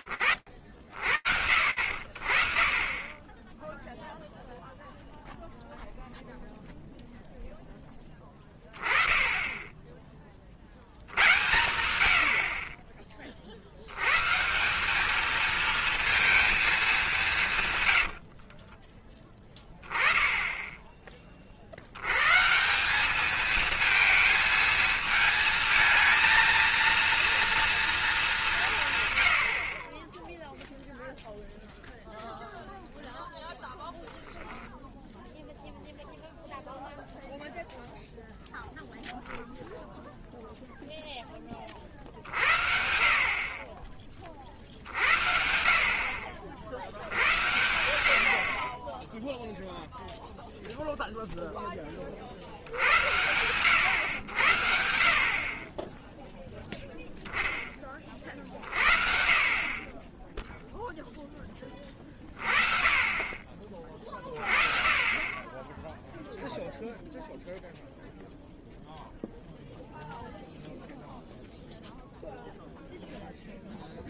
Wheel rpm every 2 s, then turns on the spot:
50, 40, 0, 0, 20, 70, 30, 190, 230, 40, 10, 180, 220, 230, 160, 0, 0, 0, 0, 0, 0, 50, 40, 60, 50, 0, 50, 80, 0, 40, 10, 30, 20, 0, 0, 0, 0.
2-4 18-20